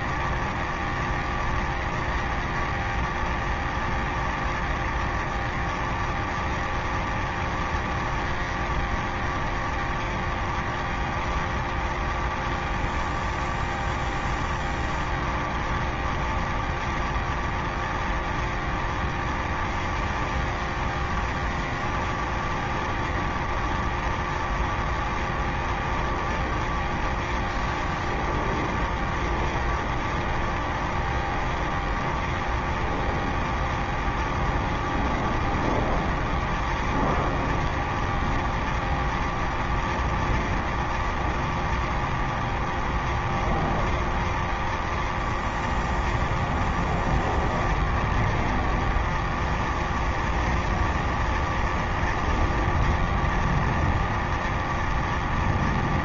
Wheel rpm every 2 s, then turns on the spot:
0, 0, 0, 0, 0, 0, 0, 0, 0, 0, 0, 0, 0, 0, 0, 0, 0, 0, 0, 0, 0, 0, 0, 0, 0, 0, 0, 0.
none